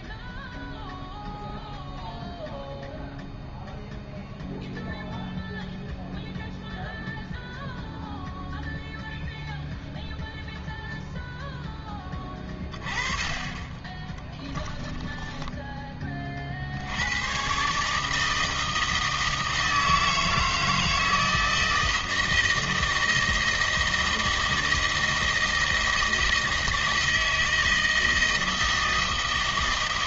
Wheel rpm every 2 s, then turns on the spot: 0, 0, 0, 0, 0, 0, 20, 20, 40, 160, 160, 160, 160, 160, 160.
14-16